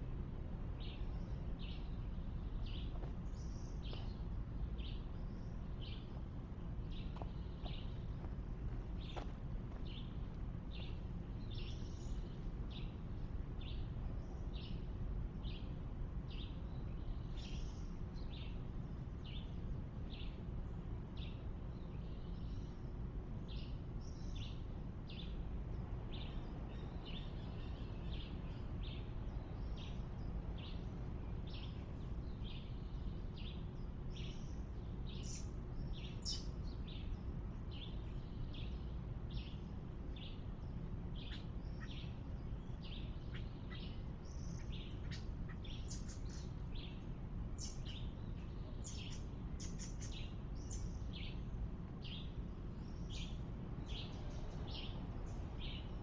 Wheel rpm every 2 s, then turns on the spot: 0, 0, 0, 0, 0, 0, 0, 0, 0, 0, 0, 0, 0, 0, 0, 0, 0, 0, 0, 0, 0, 0, 0, 0, 0, 0, 0, 0.
none